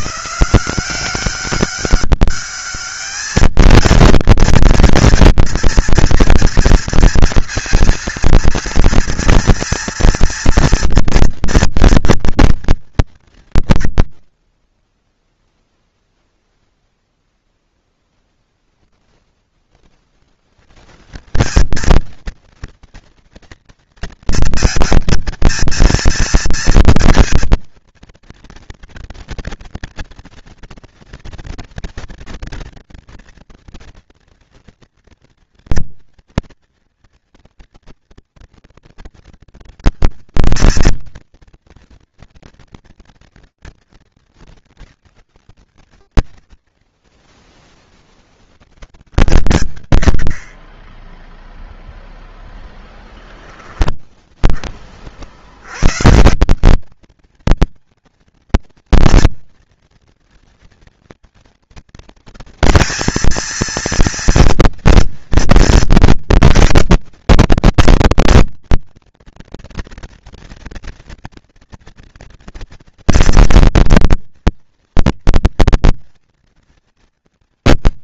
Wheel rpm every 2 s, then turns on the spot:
190, 220, 230, 230, 230, 230, 110, 0, 0, 10, 170, 230, 230, 230, 230, 230, 230, 230, 230, 230, 230, 230, 110, 40, 50, 0, 10, 140, 230, 230, 230, 230, 230, 240, 230, 230, 240, 240, 180.
52-54